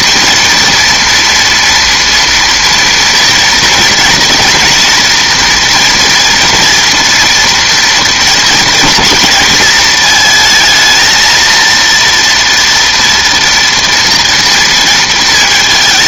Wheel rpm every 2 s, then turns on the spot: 230, 230, 240, 230, 220, 220, 230, 230.
none